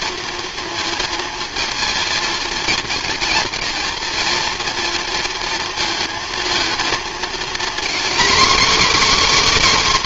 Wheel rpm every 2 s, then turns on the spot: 230, 230, 230, 230, 280.
none